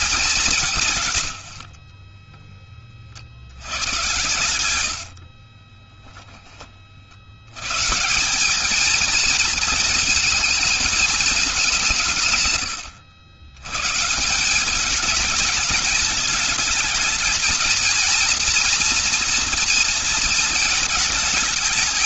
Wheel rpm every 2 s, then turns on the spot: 180, 30, 90, 20, 190, 230, 140, 180, 220, 240, 230.
4-6